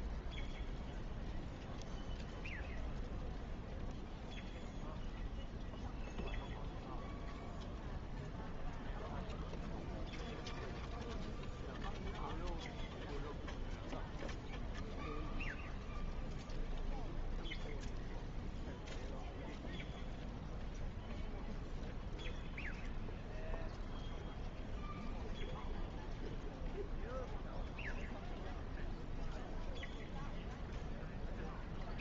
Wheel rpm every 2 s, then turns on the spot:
0, 0, 0, 0, 0, 0, 0, 0, 0, 0, 0, 0, 0, 0, 0, 0.
none